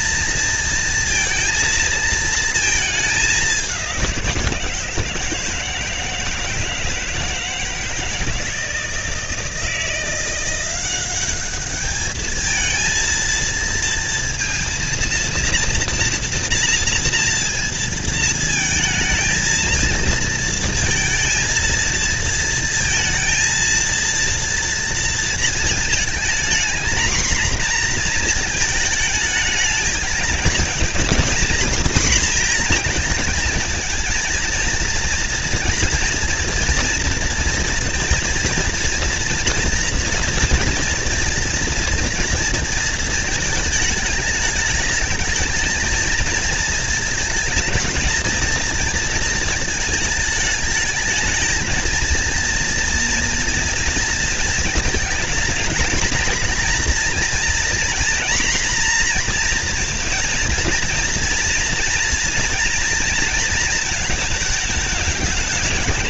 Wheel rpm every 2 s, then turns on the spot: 230, 220, 170, 160, 170, 180, 220, 230, 230, 220, 230, 230, 230, 230, 230, 230, 230, 230, 230, 230, 240, 230, 210, 220, 220, 210, 230, 230, 240, 240, 230, 240, 220.
none